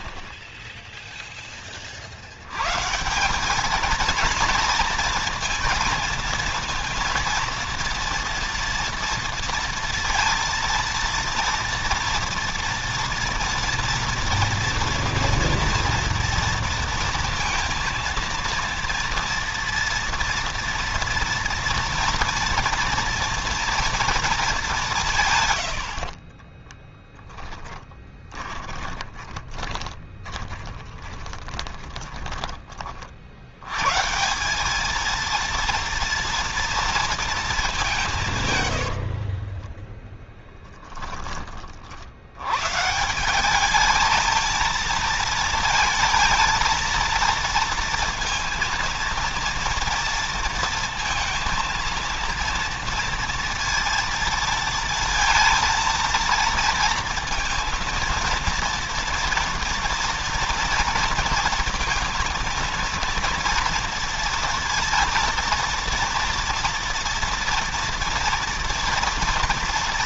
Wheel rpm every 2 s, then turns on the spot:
10, 120, 230, 230, 230, 230, 230, 230, 230, 230, 230, 230, 210, 20, 20, 20, 30, 190, 230, 120, 10, 120, 220, 230, 230, 230, 230, 230, 230, 230, 230, 230, 230, 230, 230.
26-32 38-42